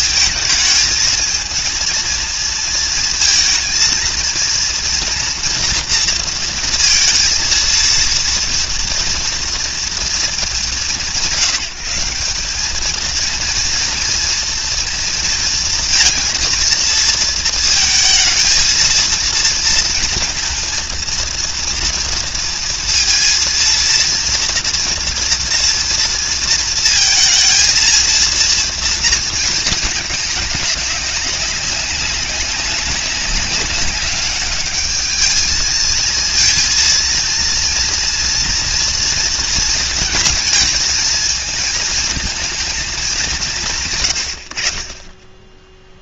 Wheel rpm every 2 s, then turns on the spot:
220, 230, 230, 230, 230, 180, 200, 230, 230, 220, 230, 230, 230, 230, 230, 200, 190, 210, 230, 230, 220, 220, 60.
none